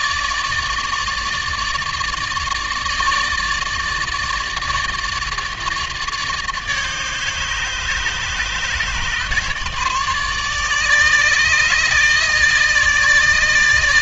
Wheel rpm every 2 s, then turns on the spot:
150, 150, 150, 150, 150, 150, 150.
none